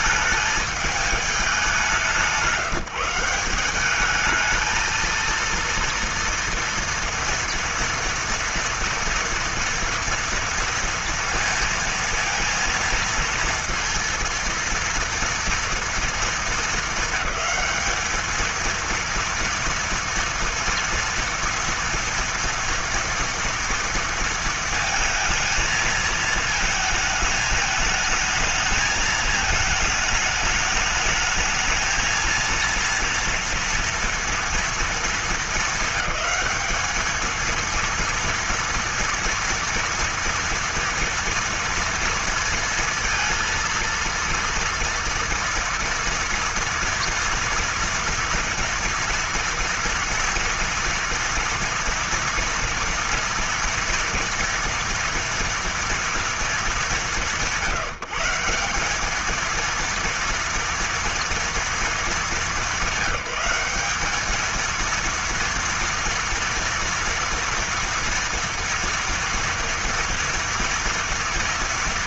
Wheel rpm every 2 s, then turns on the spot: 220, 170, 220, 230, 230, 230, 230, 230, 220, 220, 230, 230, 230, 220, 220, 220, 230, 230, 210, 230, 230, 230, 230, 230, 230, 230, 230, 230, 210, 180, 230, 200, 220, 230, 230, 240.
none